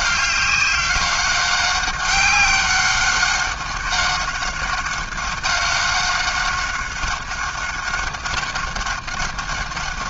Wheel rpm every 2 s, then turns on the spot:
190, 190, 190, 190, 190.
none